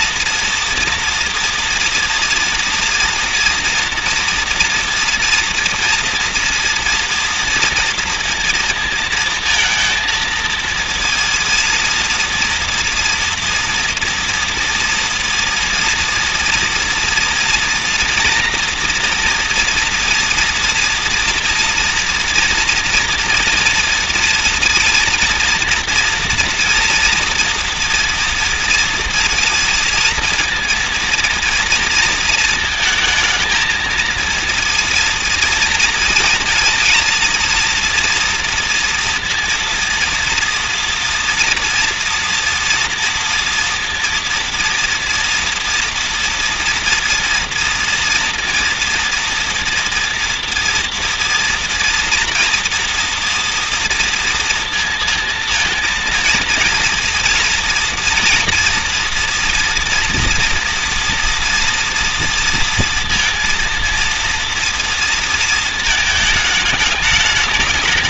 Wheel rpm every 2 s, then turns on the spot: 230, 230, 230, 230, 230, 230, 230, 240, 230, 240, 230, 230, 230, 230, 230, 220, 220, 230, 220, 230, 240, 230, 230, 230, 230, 230, 240, 230, 230, 230, 230, 230, 230, 210.
none